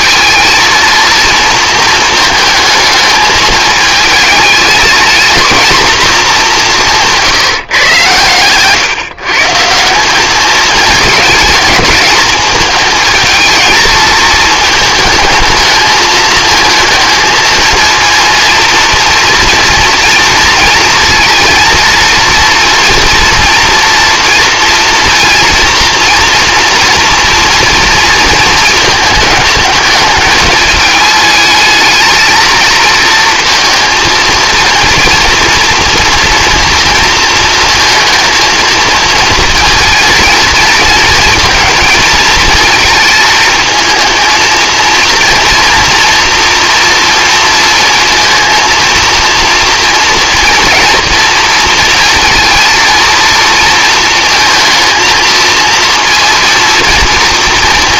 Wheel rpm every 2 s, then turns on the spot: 230, 220, 220, 190, 130, 220, 220, 220, 220, 230, 230, 230, 230, 230, 220, 220, 230, 230, 230, 220, 230, 220, 230, 230, 230, 240, 230, 220, 230.
none